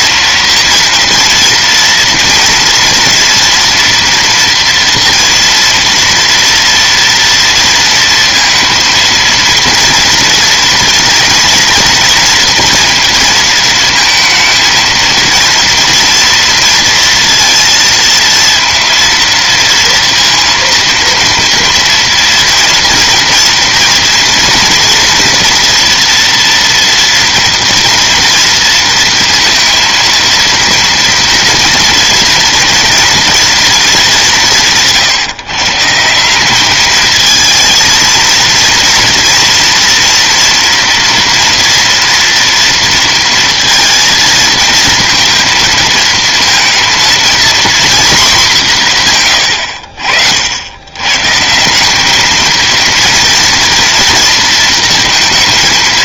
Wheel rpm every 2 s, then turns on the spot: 230, 230, 230, 230, 230, 240, 230, 230, 230, 230, 230, 230, 230, 230, 230, 230, 230, 180, 190, 230, 230, 230, 230, 220, 220, 70, 220, 230.
none